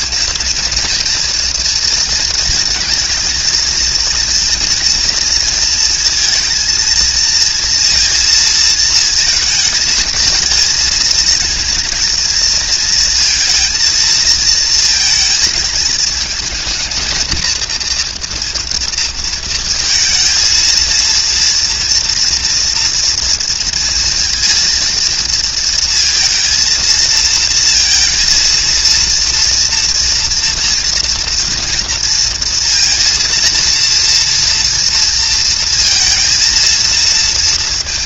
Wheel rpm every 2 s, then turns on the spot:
230, 220, 230, 230, 220, 220, 230, 220, 220, 230, 230, 230, 230, 230, 230, 230, 230, 230, 230.
none